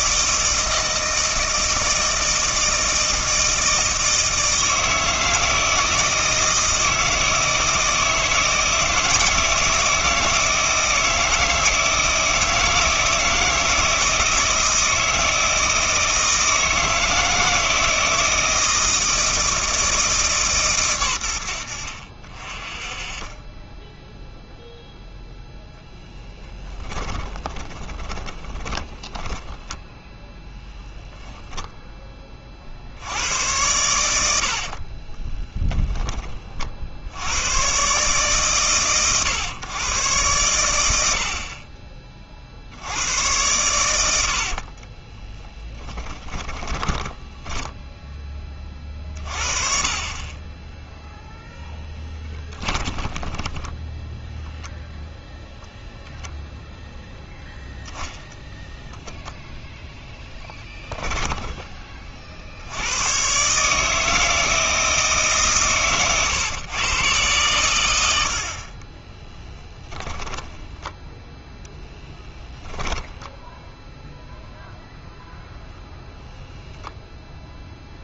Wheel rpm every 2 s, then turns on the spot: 160, 160, 160, 160, 160, 160, 170, 160, 160, 160, 120, 30, 0, 10, 10, 0, 60, 50, 50, 130, 90, 80, 40, 20, 30, 0, 10, 0, 0, 0, 10, 90, 160, 130, 40, 10, 0, 0, 0.
26-30 34-36 44-48 52-54 60-62 68-72